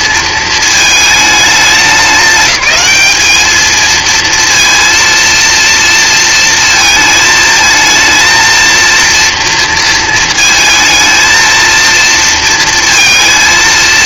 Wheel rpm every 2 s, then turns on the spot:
230, 210, 230, 220, 230, 230, 230.
none